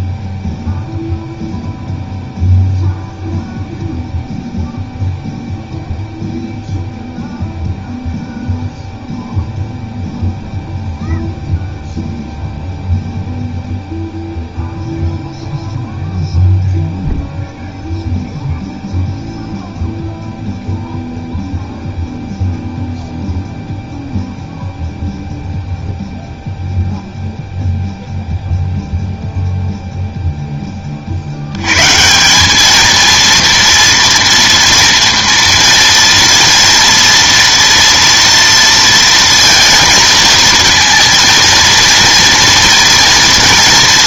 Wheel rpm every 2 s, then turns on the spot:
0, 0, 0, 0, 0, 0, 0, 0, 0, 0, 0, 0, 0, 0, 0, 10, 200, 230, 230, 230, 230, 230.
none